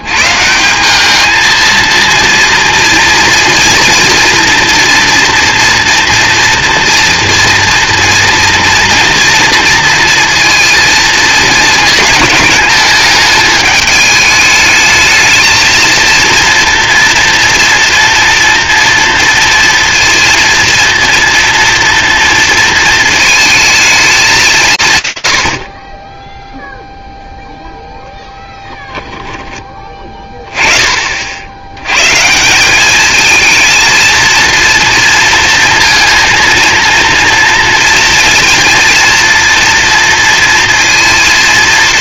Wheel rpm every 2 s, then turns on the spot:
200, 230, 230, 240, 230, 220, 210, 220, 230, 230, 230, 230, 130, 0, 10, 30, 210, 230, 230, 230, 230.
28-30